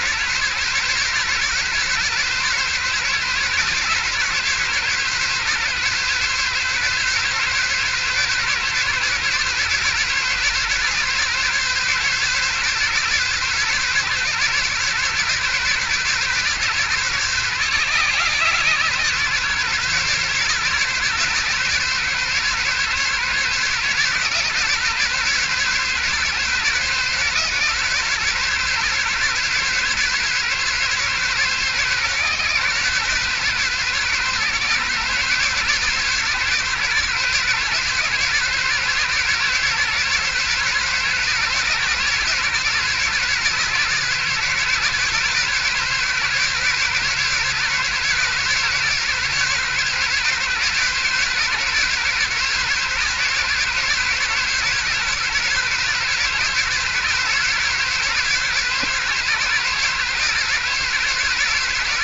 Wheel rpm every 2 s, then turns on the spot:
140, 140, 140, 140, 140, 140, 140, 140, 130, 130, 140, 140, 140, 140, 140, 130, 130, 140, 140, 130, 140, 140, 140, 140, 140, 140, 140, 140, 140, 140, 140.
none